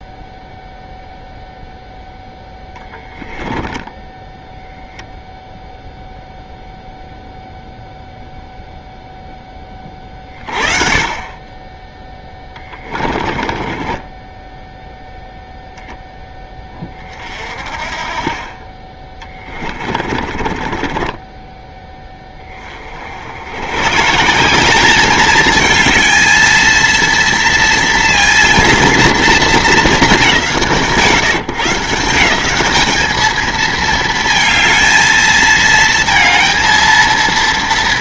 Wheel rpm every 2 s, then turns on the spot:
0, 10, 0, 0, 10, 40, 20, 0, 30, 20, 20, 50, 200, 230, 230, 140, 210, 230, 230.
12-14 18-22